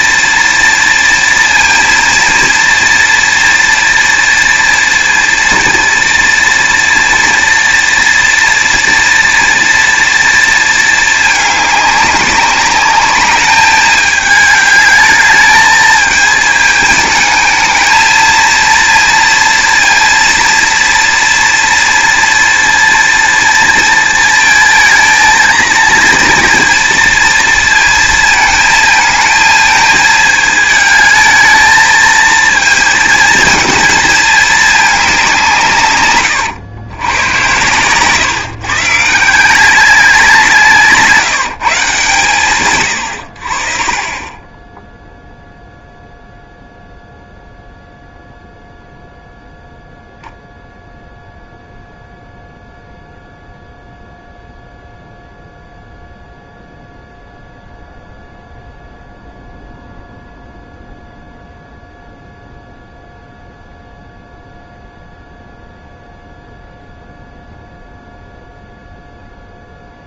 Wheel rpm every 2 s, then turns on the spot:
230, 230, 230, 230, 230, 220, 200, 210, 220, 230, 230, 230, 220, 230, 220, 220, 230, 210, 100, 140, 160, 110, 0, 0, 0, 0, 0, 0, 0, 0, 0, 0, 0, 0, 0.
40-42